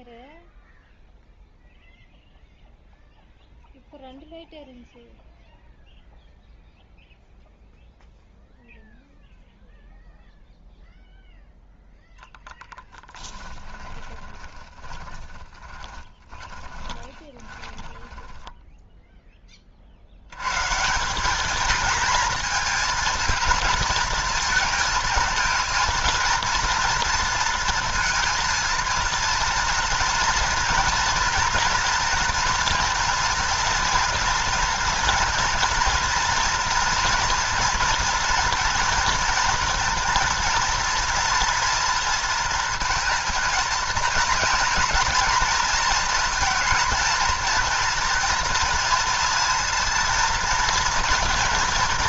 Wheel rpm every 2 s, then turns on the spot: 0, 0, 0, 0, 0, 0, 10, 20, 20, 10, 140, 220, 220, 230, 230, 230, 230, 230, 230, 230, 230, 230, 230, 230, 230, 230.
12-20